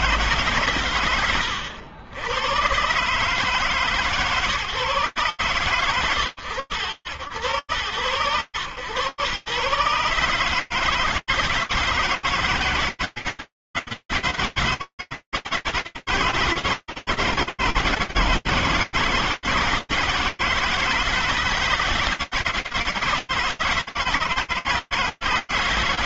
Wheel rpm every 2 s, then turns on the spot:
110, 140, 120, 110, 120, 160, 160, 160, 160, 160, 160, 160, 160.
none